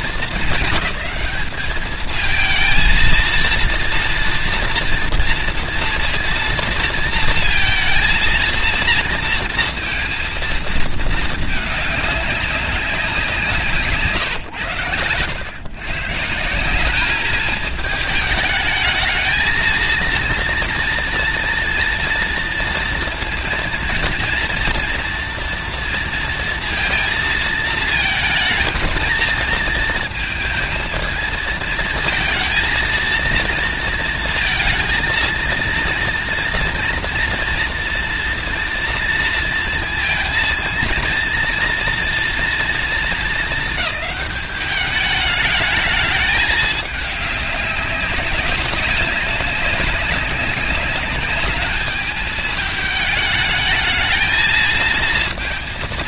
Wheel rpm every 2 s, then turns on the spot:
200, 230, 230, 230, 230, 220, 180, 100, 200, 220, 240, 230, 230, 230, 230, 220, 230, 230, 230, 230, 230, 230, 210, 200, 190, 210, 210, 230.
none